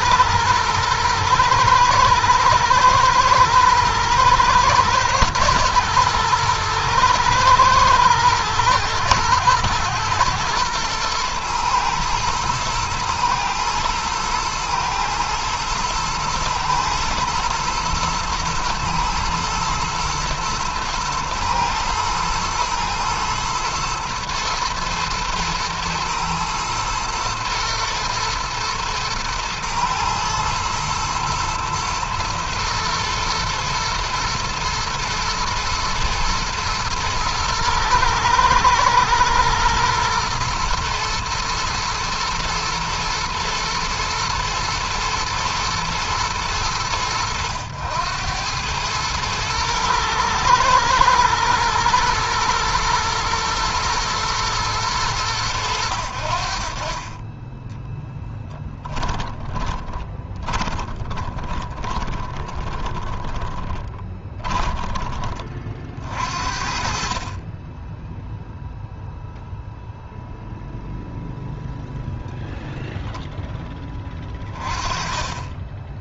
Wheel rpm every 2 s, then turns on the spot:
110, 110, 110, 110, 120, 120, 120, 110, 110, 110, 110, 110, 110, 120, 110, 120, 120, 110, 110, 110, 120, 120, 110, 100, 110, 120, 120, 100, 20, 20, 30, 30, 30, 30, 0, 0, 10, 20.
58-64